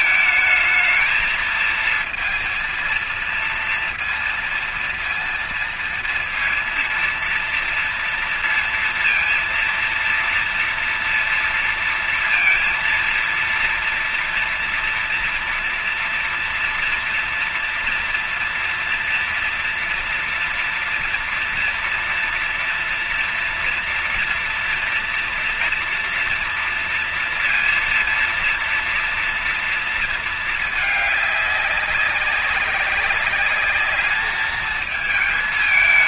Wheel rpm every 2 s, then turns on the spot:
220, 230, 230, 230, 230, 230, 230, 230, 230, 230, 230, 230, 240, 240, 230, 220, 200, 210.
none